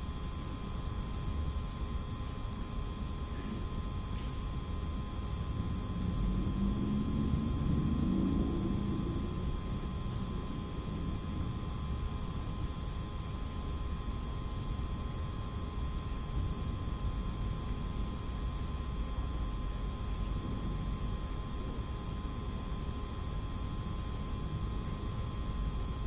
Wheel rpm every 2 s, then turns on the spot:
0, 0, 0, 0, 0, 0, 0, 0, 0, 0, 0, 0, 0.
none